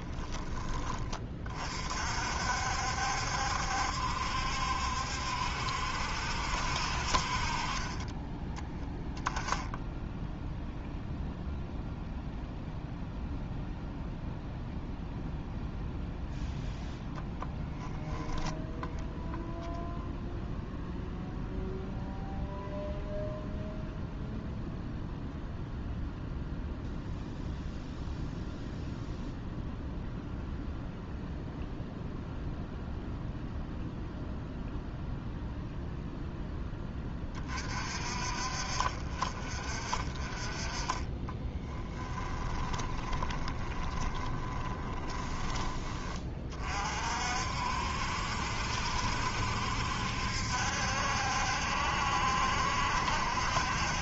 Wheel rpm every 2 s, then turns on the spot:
20, 60, 70, 60, 10, 0, 0, 0, 0, 0, 0, 0, 0, 0, 0, 0, 0, 0, 20, 40, 20, 20, 20, 40, 70, 70, 70.
40-46